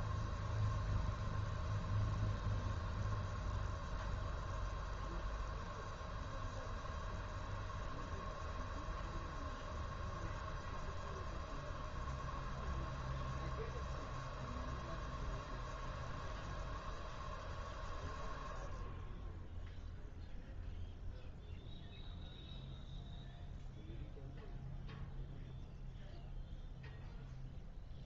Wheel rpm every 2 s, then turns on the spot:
0, 0, 0, 0, 0, 0, 0, 0, 0, 0, 0, 0, 0, 0.
none